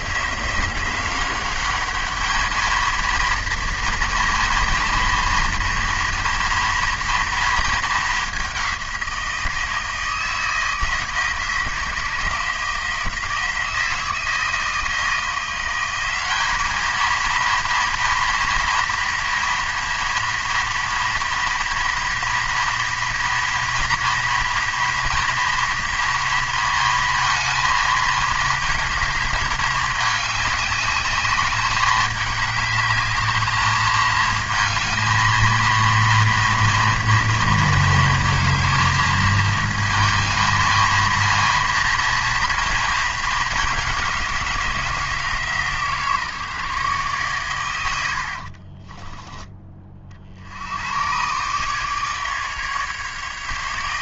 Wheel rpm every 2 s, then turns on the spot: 190, 220, 230, 240, 190, 160, 160, 160, 210, 240, 230, 230, 230, 230, 220, 200, 210, 230, 230, 220, 220, 220, 170, 150, 40, 80, 150.
48-50